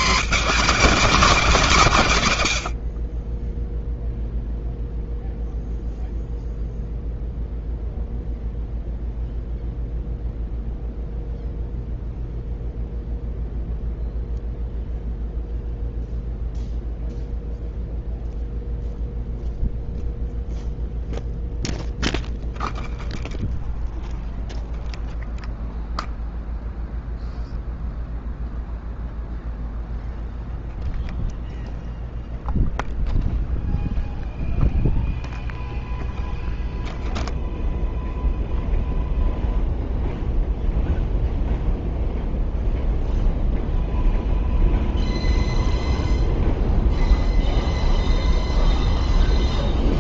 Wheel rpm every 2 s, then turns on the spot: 230, 120, 0, 0, 0, 0, 0, 0, 0, 0, 0, 0, 0, 0, 0, 0, 0, 0, 0, 0, 0, 0, 0, 0, 0.
none